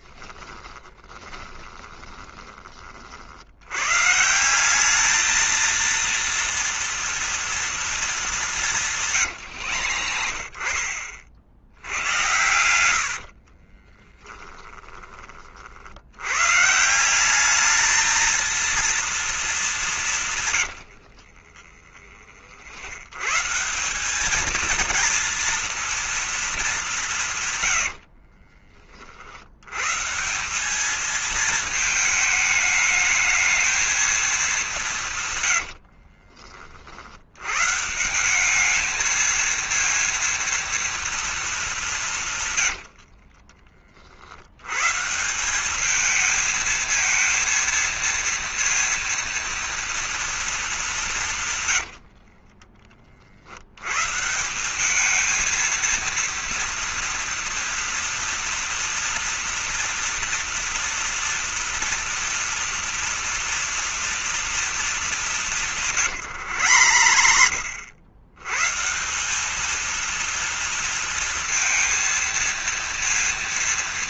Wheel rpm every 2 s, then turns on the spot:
20, 20, 170, 230, 200, 70, 100, 10, 140, 220, 110, 60, 220, 200, 40, 200, 220, 200, 40, 210, 230, 110, 100, 220, 230, 230, 30, 180, 230, 230, 230, 230, 230, 120, 120, 230, 230.
0-2 12-16 20-22 42-44 52-54 66-68